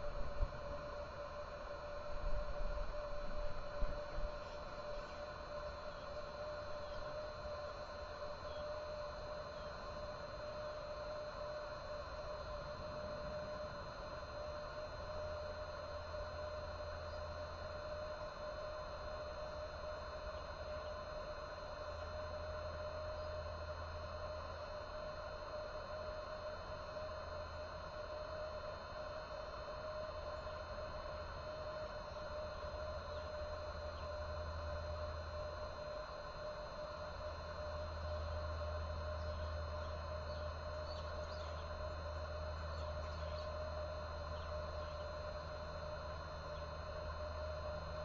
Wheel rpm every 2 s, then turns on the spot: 0, 0, 0, 0, 0, 0, 0, 0, 0, 0, 0, 0, 0, 0, 0, 0, 0, 0, 0, 0, 0, 0, 0, 0.
none